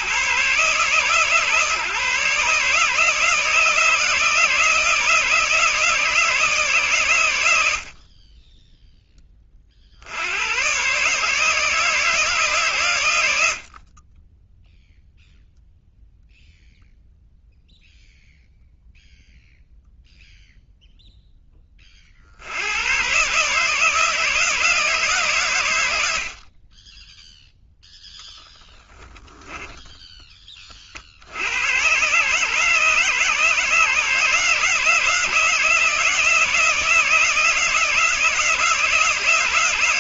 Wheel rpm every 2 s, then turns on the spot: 150, 150, 160, 130, 10, 130, 110, 0, 0, 0, 0, 90, 150, 10, 10, 50, 150, 170, 160, 160.
28-30